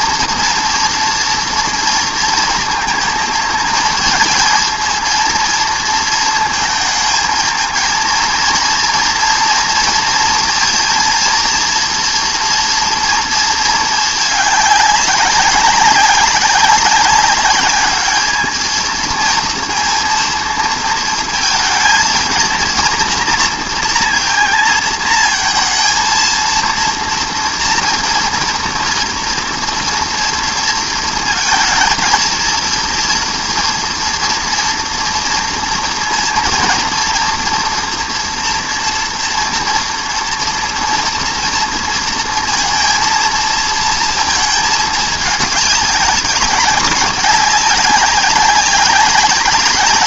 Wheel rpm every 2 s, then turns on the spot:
230, 230, 230, 230, 230, 230, 230, 200, 190, 220, 230, 230, 230, 230, 240, 230, 230, 230, 230, 240, 230, 230, 220, 200, 190.
none